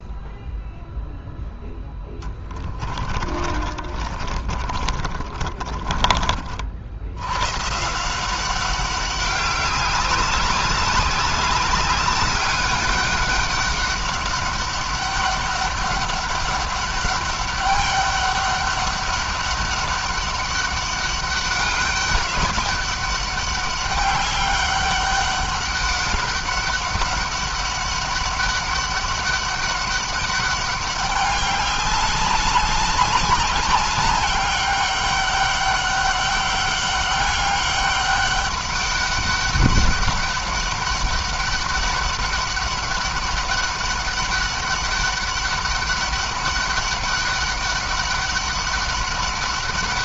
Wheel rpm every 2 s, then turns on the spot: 0, 30, 40, 70, 190, 200, 200, 200, 200, 200, 200, 200, 200, 200, 200, 200, 200, 200, 200, 200, 200, 200, 200, 200, 200.
2-6